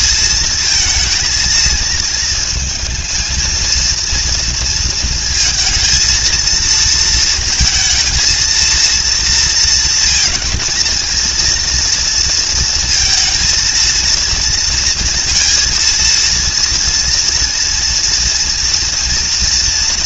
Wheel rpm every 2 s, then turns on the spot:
220, 230, 230, 230, 230, 230, 220, 230, 230, 230.
none